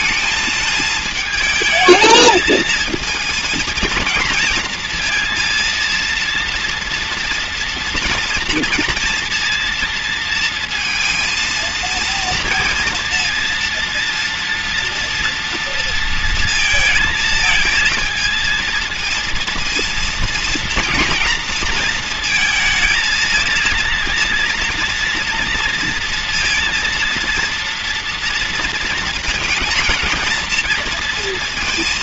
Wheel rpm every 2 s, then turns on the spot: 220, 230, 230, 230, 230, 230, 230, 230, 220, 230, 230, 230, 230, 230, 230, 230.
none